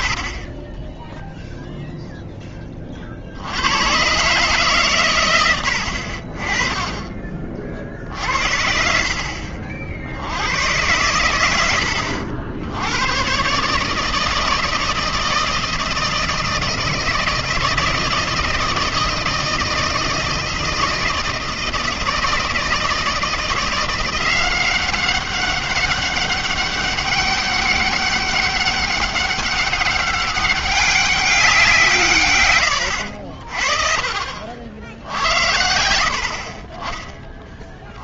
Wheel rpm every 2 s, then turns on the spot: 20, 10, 140, 30, 60, 100, 80, 160, 160, 160, 160, 160, 190, 200, 200, 200, 100, 70, 30.
none